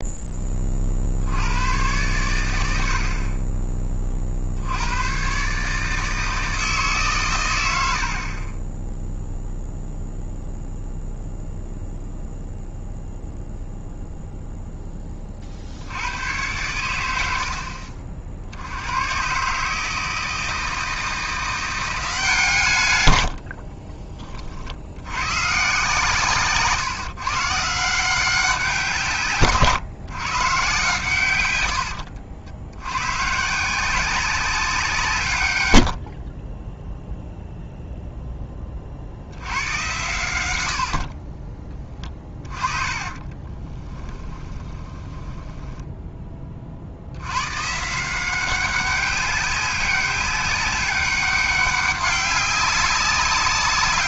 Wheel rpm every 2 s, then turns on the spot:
30, 90, 70, 160, 20, 0, 0, 0, 110, 80, 160, 150, 50, 140, 180, 130, 90, 180, 20, 20, 80, 30, 20, 50, 190, 200, 200.
42-46